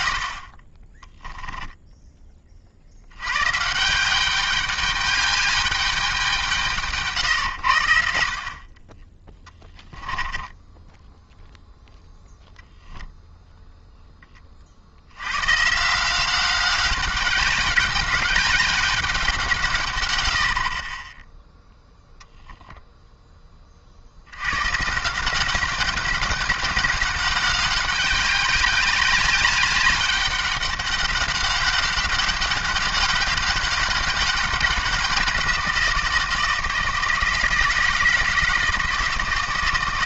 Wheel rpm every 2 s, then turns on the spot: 30, 60, 200, 150, 30, 10, 0, 50, 190, 190, 50, 0, 130, 190, 200, 200, 200, 190, 160, 160.
10-12